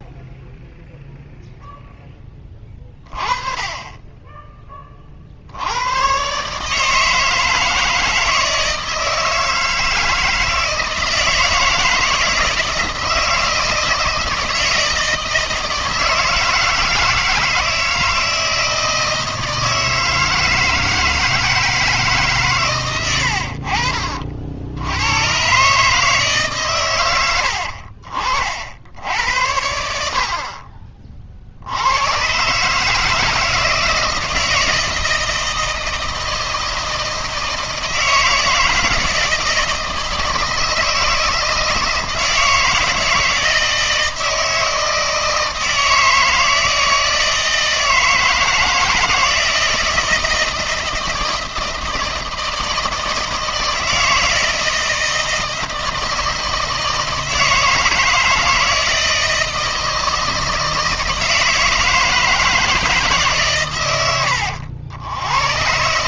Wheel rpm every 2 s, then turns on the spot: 0, 20, 10, 150, 160, 160, 160, 160, 160, 160, 160, 120, 80, 140, 70, 30, 150, 160, 160, 160, 160, 160, 160, 160, 160, 160, 160, 160, 160, 160, 160, 160, 80.
none